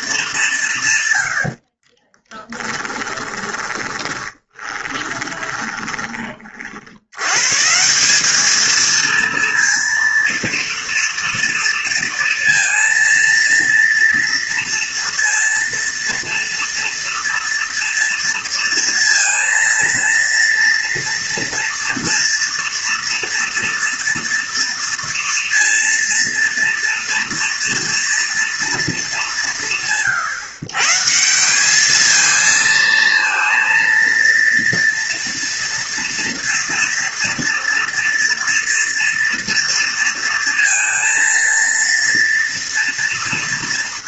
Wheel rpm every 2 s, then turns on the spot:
140, 10, 20, 60, 220, 230, 230, 230, 230, 230, 230, 230, 230, 230, 230, 140, 230, 230, 240, 230, 230, 230.
2-6